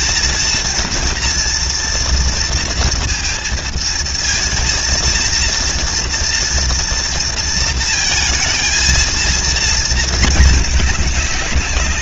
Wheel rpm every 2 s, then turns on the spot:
230, 230, 230, 230, 220, 210.
none